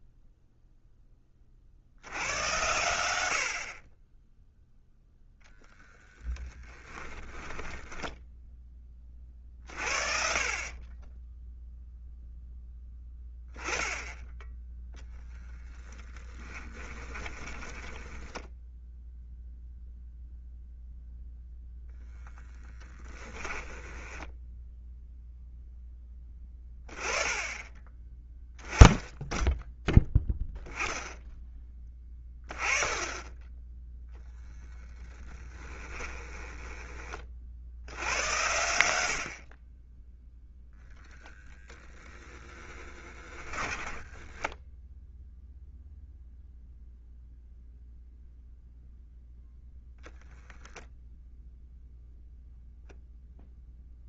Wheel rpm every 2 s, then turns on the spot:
0, 100, 0, 10, 20, 30, 10, 10, 20, 0, 0, 10, 10, 20, 10, 10, 20, 10, 20, 80, 0, 10, 10, 0, 0, 0, 0.
6-8 16-18 22-26 34-36 42-44